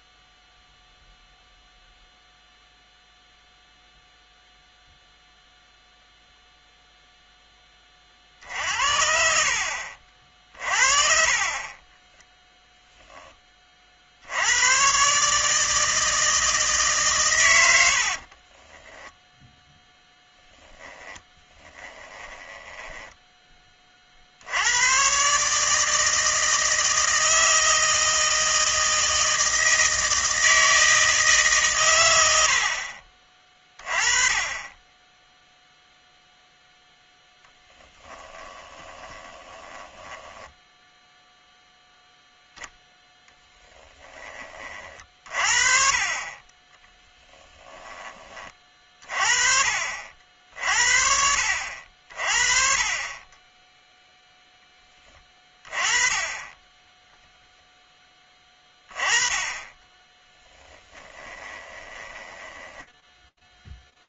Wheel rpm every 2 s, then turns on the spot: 0, 0, 0, 0, 60, 40, 10, 140, 130, 10, 10, 10, 120, 160, 160, 160, 50, 10, 10, 20, 0, 10, 30, 30, 30, 60, 40, 10, 10, 20, 20, 10.
10-12 18-22 38-40 46-48 56-58 60-64